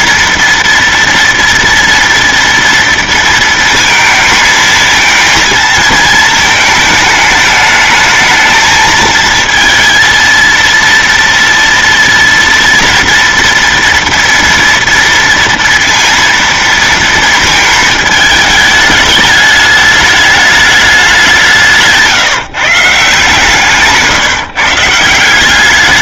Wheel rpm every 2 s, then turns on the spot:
230, 230, 220, 220, 220, 230, 230, 230, 230, 210, 210, 150, 160.
none